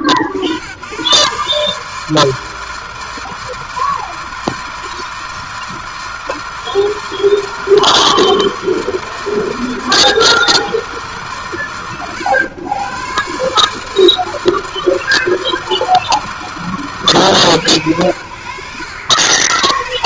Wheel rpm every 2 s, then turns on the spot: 90, 160, 160, 160, 160, 160, 100, 160, 160, 80.
none